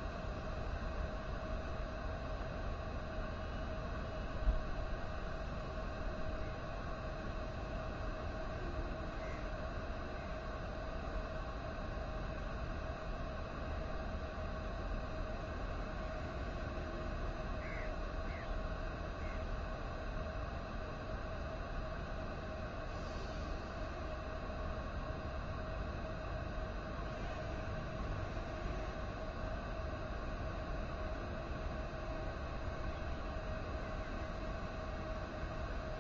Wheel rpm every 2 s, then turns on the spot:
0, 0, 0, 0, 0, 0, 0, 0, 0, 0, 0, 0, 0, 0, 0, 0, 0, 0.
none